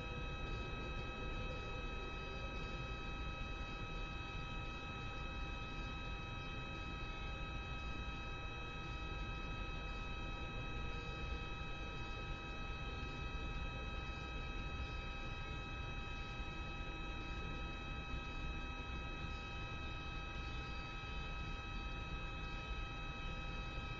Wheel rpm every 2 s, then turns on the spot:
0, 0, 0, 0, 0, 0, 0, 0, 0, 0, 0, 0.
none